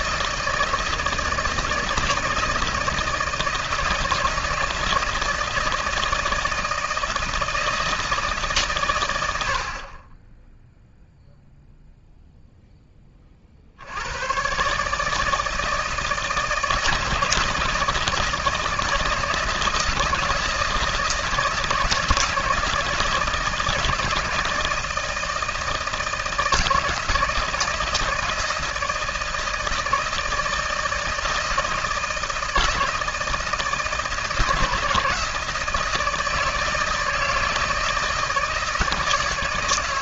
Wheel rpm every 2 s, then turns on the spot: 160, 160, 160, 160, 120, 0, 10, 150, 160, 160, 160, 160, 160, 160, 160, 160, 160, 160, 160, 160.
none